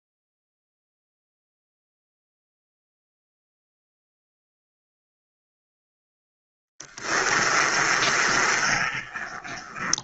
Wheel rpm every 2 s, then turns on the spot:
0, 0, 0, 10, 30.
6-10